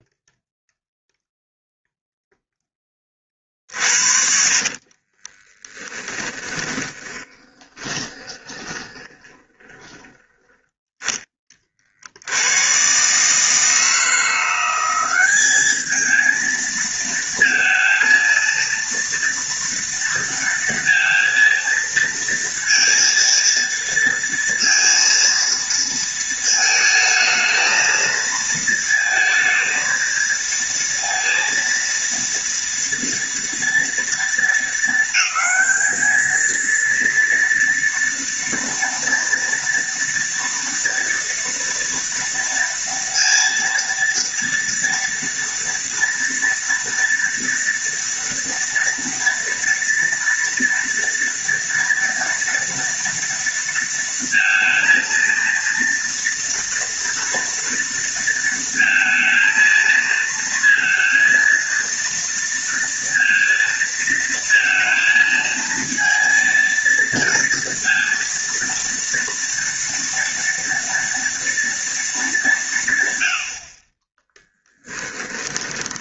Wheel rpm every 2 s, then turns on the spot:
0, 10, 50, 10, 20, 10, 100, 170, 220, 230, 230, 230, 230, 220, 220, 230, 230, 230, 220, 230, 230, 230, 230, 240, 240, 230, 230, 230, 230, 230, 230, 230, 230, 230, 230, 240, 190, 20.
4-10 74-76